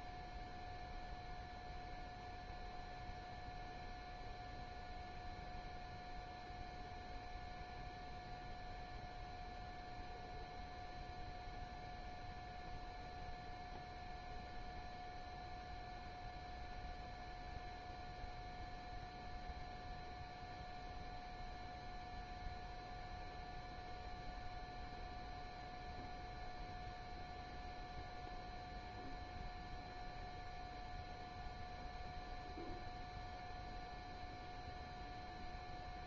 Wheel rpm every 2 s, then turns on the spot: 0, 0, 0, 0, 0, 0, 0, 0, 0, 0, 0, 0, 0, 0, 0, 0, 0, 0.
none